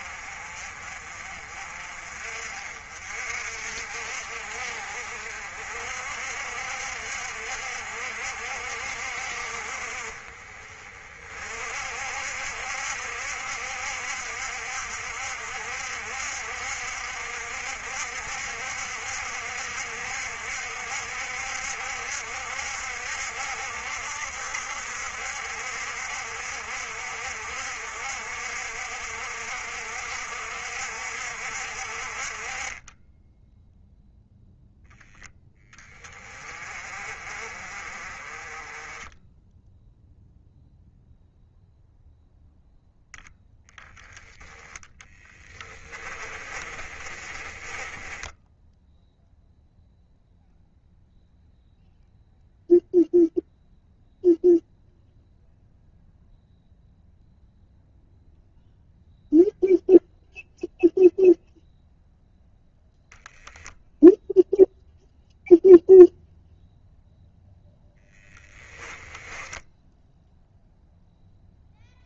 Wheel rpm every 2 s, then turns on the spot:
40, 50, 50, 60, 60, 40, 70, 60, 60, 60, 60, 60, 60, 60, 60, 60, 20, 10, 30, 20, 0, 0, 10, 30, 0, 0, 0, 0, 0, 0, 0, 0, 0, 0, 20, 0.
32-34 46-48 68-70